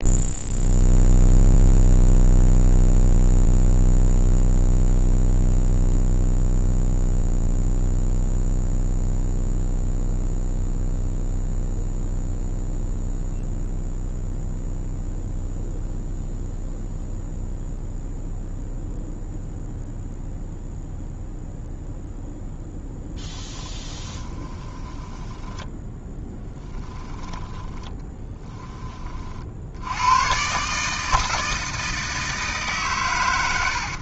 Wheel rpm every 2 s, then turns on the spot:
0, 0, 0, 0, 0, 0, 0, 0, 0, 0, 0, 0, 10, 20, 30, 150, 130.
24-28